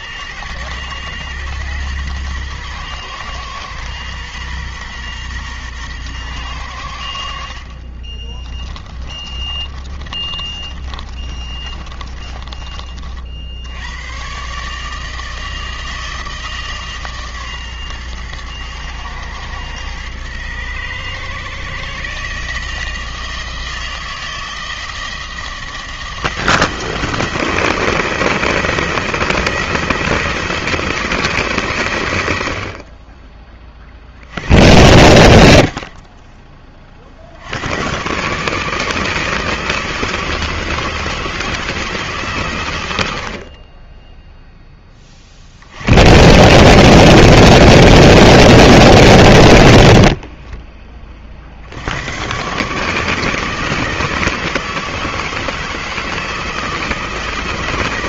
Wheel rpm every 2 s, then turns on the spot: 110, 120, 120, 80, 30, 30, 40, 150, 150, 110, 120, 160, 160, 160, 170, 170, 40, 90, 40, 160, 160, 100, 20, 150, 140, 30, 150, 160, 160.
8-12